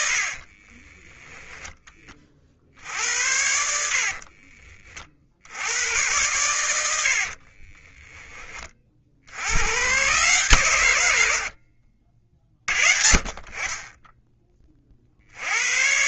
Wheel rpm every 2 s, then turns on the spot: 20, 60, 40, 80, 50, 110, 40, 40.
0-2